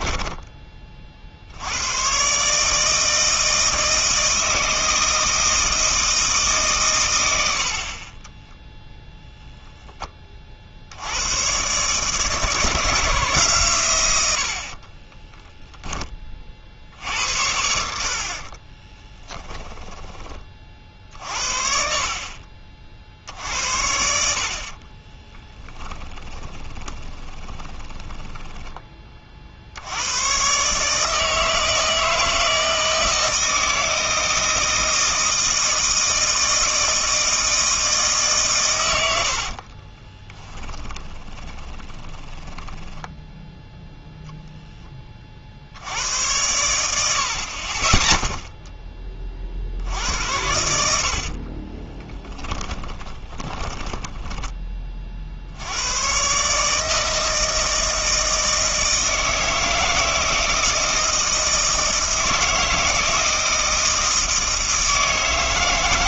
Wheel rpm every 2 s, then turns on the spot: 20, 150, 160, 140, 0, 60, 160, 50, 60, 20, 40, 50, 40, 20, 10, 140, 160, 160, 160, 110, 20, 10, 20, 80, 10, 70, 20, 30, 150, 160, 160, 160, 160.
14-16 18-20 26-28 40-44 52-54